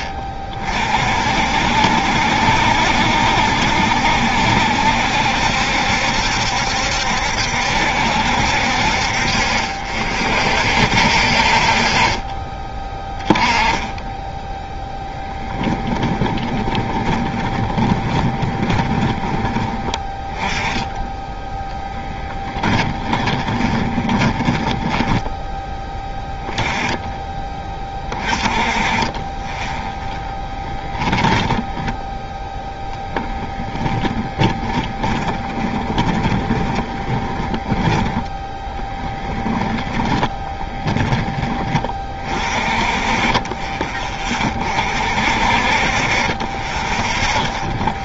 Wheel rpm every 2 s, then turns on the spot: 40, 70, 70, 70, 60, 60, 20, 10, 20, 20, 10, 20, 10, 10, 20, 30, 20, 10, 20, 10, 10, 30, 40, 20.
14-20 22-26 30-32 34-38 40-42 46-48